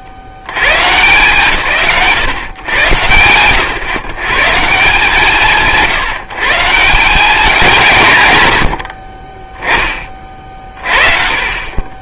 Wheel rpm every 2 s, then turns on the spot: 50, 130, 130, 150, 100, 30.
none